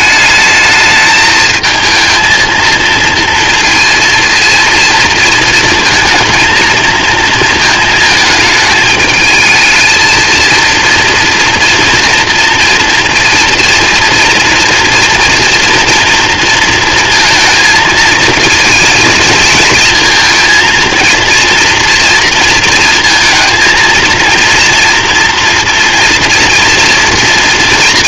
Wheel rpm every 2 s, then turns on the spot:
220, 230, 230, 230, 220, 230, 230, 230, 230, 220, 230, 230, 230, 230.
none